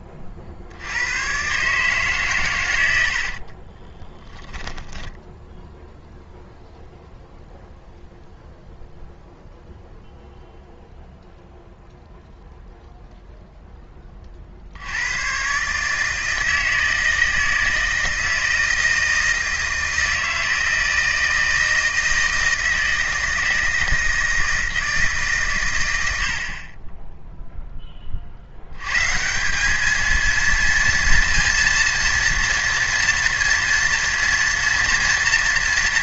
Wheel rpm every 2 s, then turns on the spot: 50, 110, 10, 0, 0, 0, 0, 50, 160, 160, 160, 160, 160, 40, 80, 230, 230, 230.
4-6